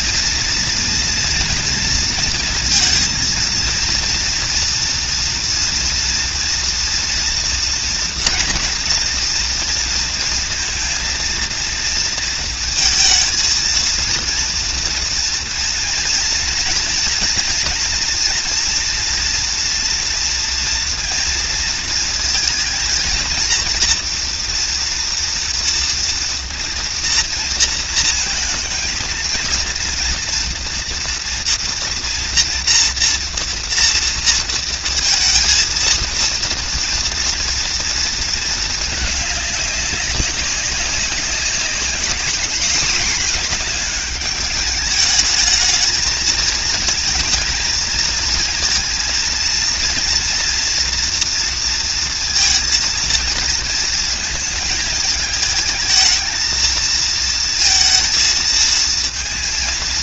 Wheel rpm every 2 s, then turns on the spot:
230, 230, 230, 230, 230, 230, 230, 230, 230, 230, 230, 230, 230, 230, 230, 230, 230, 230, 230, 220, 190, 220, 210, 230, 230, 230, 230, 220, 230, 220.
none